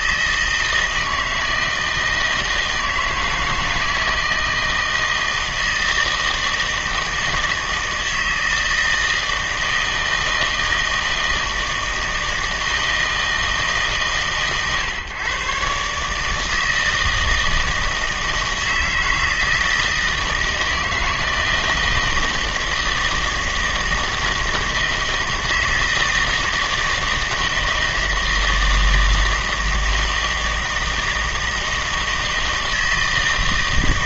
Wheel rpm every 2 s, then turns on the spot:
160, 160, 160, 160, 160, 160, 160, 130, 160, 160, 160, 160, 160, 160, 160, 160, 160.
none